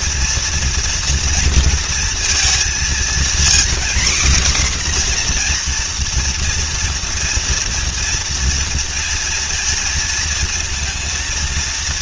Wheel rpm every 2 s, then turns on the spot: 230, 220, 260, 230, 240, 230.
none